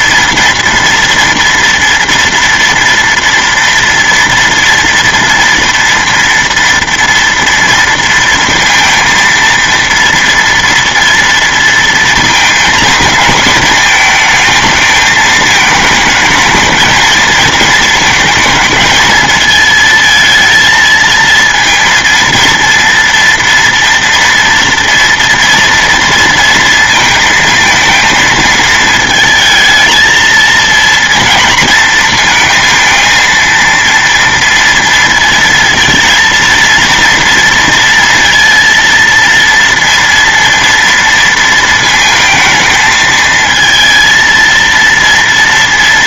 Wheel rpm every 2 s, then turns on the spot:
230, 230, 230, 230, 230, 230, 230, 220, 220, 220, 220, 230, 230, 230, 220, 230, 230, 230, 230, 230, 230, 220, 230.
none